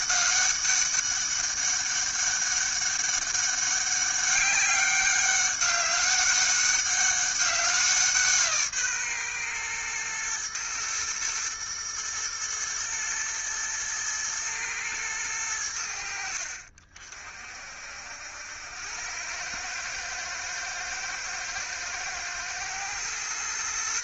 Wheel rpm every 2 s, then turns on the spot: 200, 200, 200, 190, 130, 120, 110, 90, 50, 100, 110, 130.
none